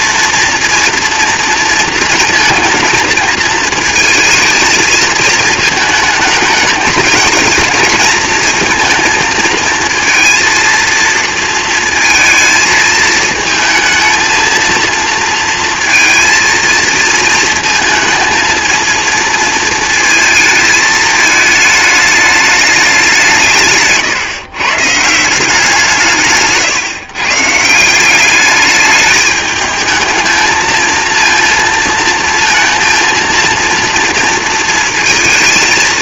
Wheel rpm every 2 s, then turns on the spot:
230, 220, 220, 220, 230, 230, 220, 230, 230, 230, 220, 200, 140, 150, 210, 220, 230, 230.
none